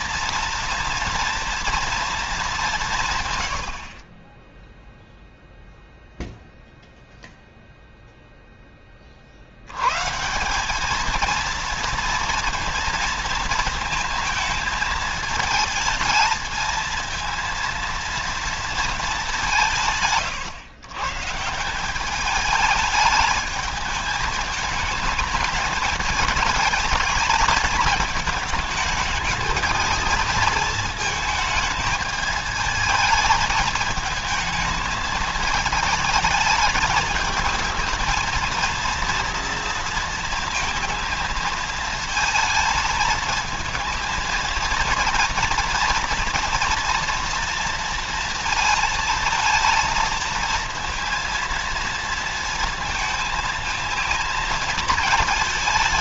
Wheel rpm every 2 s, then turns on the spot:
230, 190, 10, 0, 30, 210, 230, 220, 220, 230, 130, 210, 210, 220, 220, 220, 220, 220, 220, 230, 230, 220, 230, 230, 220, 230, 220, 220.
none